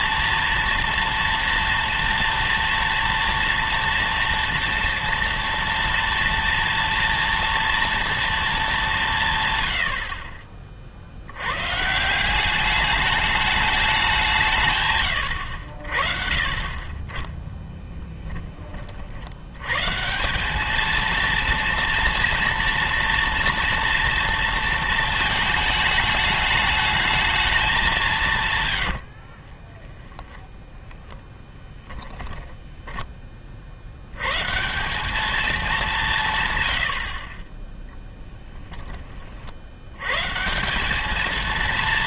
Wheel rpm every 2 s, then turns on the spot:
230, 230, 230, 230, 210, 40, 210, 150, 30, 30, 220, 230, 230, 220, 130, 10, 10, 150, 110, 10, 180.
30-34